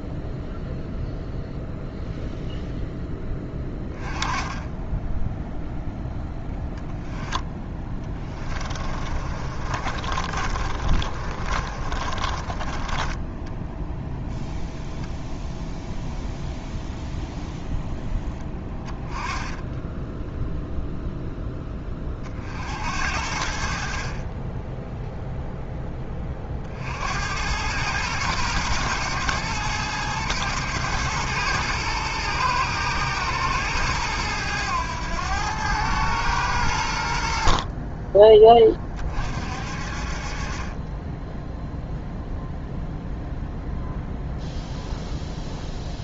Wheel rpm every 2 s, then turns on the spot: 0, 10, 10, 10, 30, 40, 20, 0, 0, 20, 0, 80, 10, 70, 110, 110, 110, 100, 80, 30, 20, 0, 0.
8-14 18-20